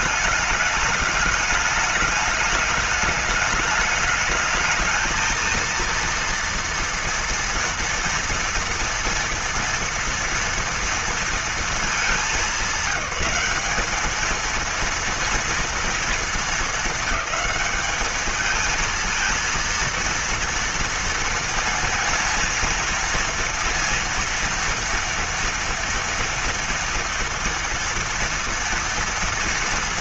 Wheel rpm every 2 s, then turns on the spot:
210, 210, 220, 230, 230, 230, 200, 220, 220, 220, 230, 230, 230, 230, 230.
none